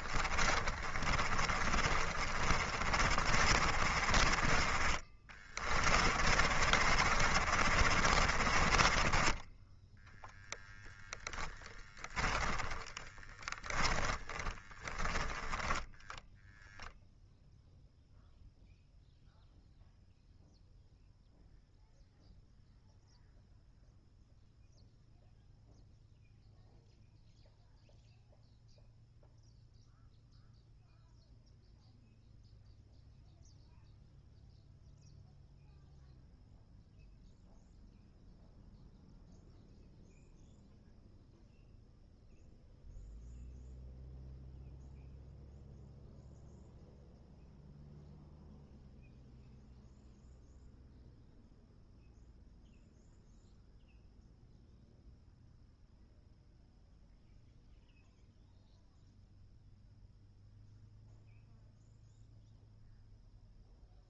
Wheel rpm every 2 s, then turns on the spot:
30, 30, 30, 40, 30, 0, 10, 10, 0, 0, 0, 0, 0, 0, 0, 0, 0, 0, 0, 0, 0, 0, 0, 0, 0, 0, 0, 0, 0, 0, 0, 0.
0-10 12-16